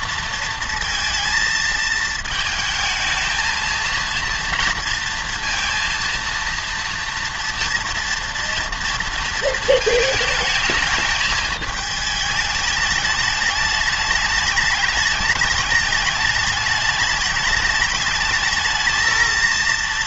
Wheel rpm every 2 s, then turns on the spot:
230, 220, 230, 230, 230, 220, 210, 210, 210, 210.
none